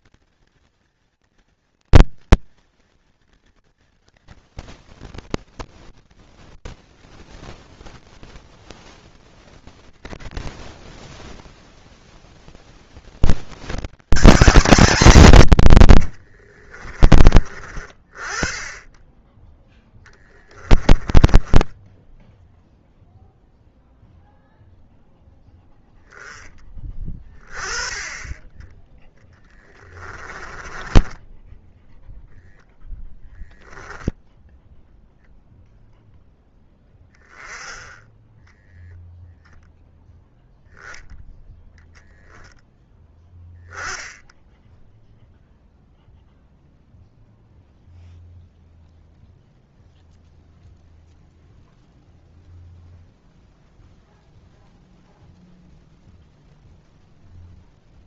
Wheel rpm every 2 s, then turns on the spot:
230, 200, 30, 10, 10, 10, 40, 200, 40, 20, 30, 0, 0, 20, 20, 20, 0, 0, 10, 0, 0, 10, 0, 0, 0, 0, 0, 0, 0.
4-8 16-18 20-22 28-32